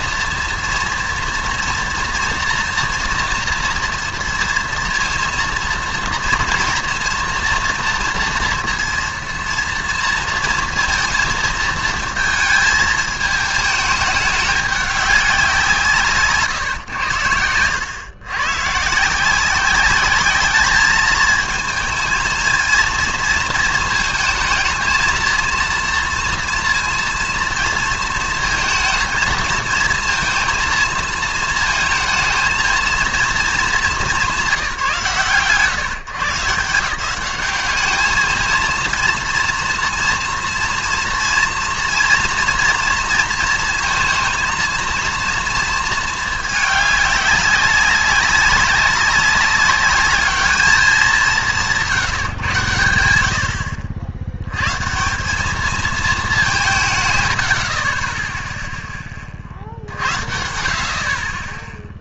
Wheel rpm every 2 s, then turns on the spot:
230, 230, 230, 230, 230, 230, 220, 200, 150, 130, 210, 220, 230, 230, 230, 230, 230, 160, 160, 220, 230, 230, 230, 210, 200, 210, 120, 110, 180, 0, 50.
none